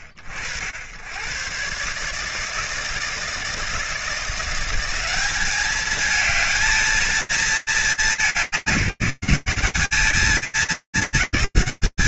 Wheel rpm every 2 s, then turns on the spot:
90, 160, 190, 220, 190, 210.
none